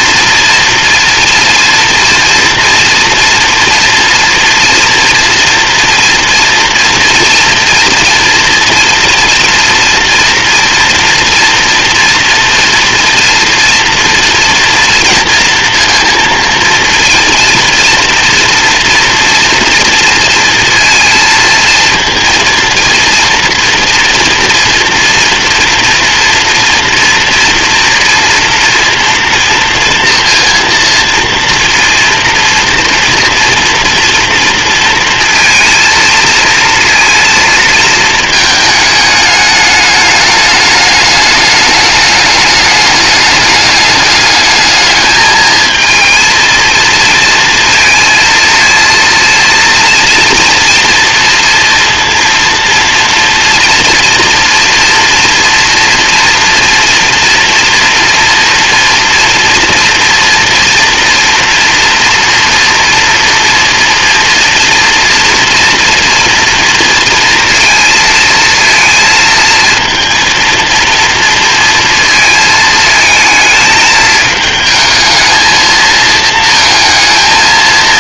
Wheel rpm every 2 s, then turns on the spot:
230, 230, 230, 230, 230, 240, 230, 230, 230, 230, 230, 240, 230, 230, 230, 230, 230, 230, 230, 210, 210, 210, 220, 230, 230, 230, 230, 230, 240, 240, 240, 230, 230, 230, 230, 230, 220, 220, 220.
none